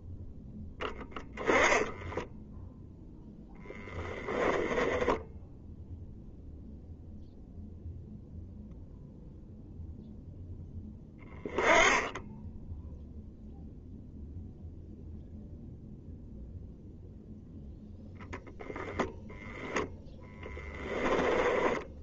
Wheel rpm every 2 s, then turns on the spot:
0, 0, 10, 0, 0, 10, 10, 0, 0, 0, 10.
4-6 20-22